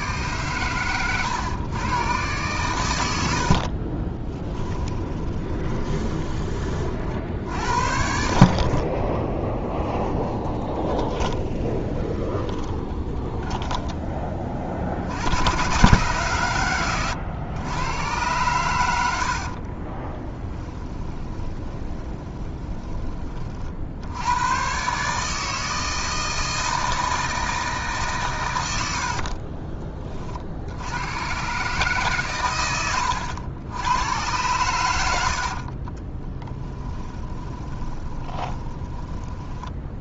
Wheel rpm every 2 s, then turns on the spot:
120, 100, 20, 50, 30, 20, 20, 60, 100, 90, 10, 20, 130, 160, 80, 90, 90, 80, 10, 20.
4-6 10-14 20-24 28-30 32-34 36-40